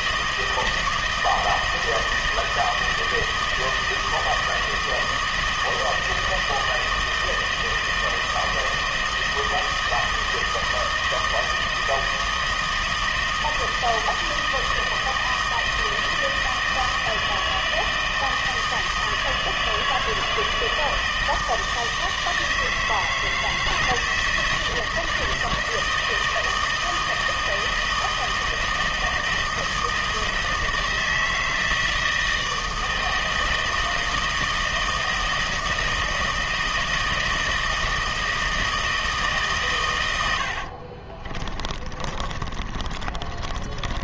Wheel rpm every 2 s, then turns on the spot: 160, 160, 160, 160, 160, 160, 160, 160, 160, 160, 160, 160, 160, 160, 160, 160, 160, 160, 160, 160, 60, 40.
40-44